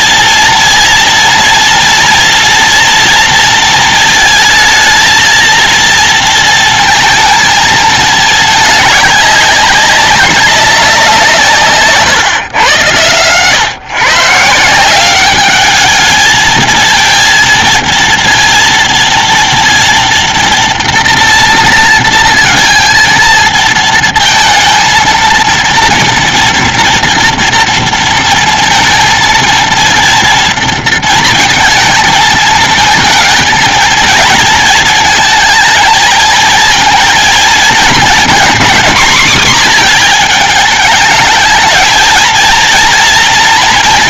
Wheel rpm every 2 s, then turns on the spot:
230, 230, 220, 230, 220, 200, 140, 150, 220, 230, 230, 230, 230, 240, 230, 230, 220, 230, 220, 230, 230, 220.
12-14